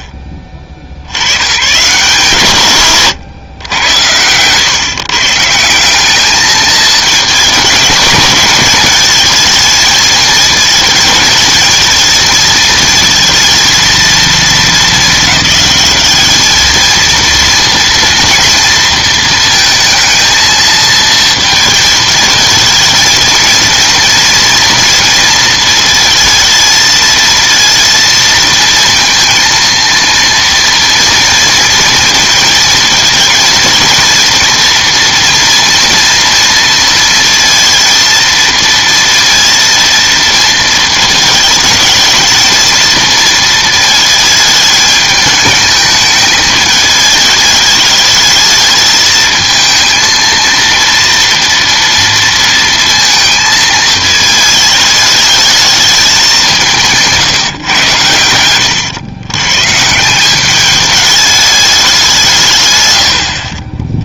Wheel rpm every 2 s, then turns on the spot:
50, 140, 130, 220, 220, 220, 220, 220, 220, 230, 230, 220, 230, 230, 230, 230, 230, 240, 230, 230, 220, 220, 210, 210, 220, 230, 230, 210, 180, 110, 200, 130.
none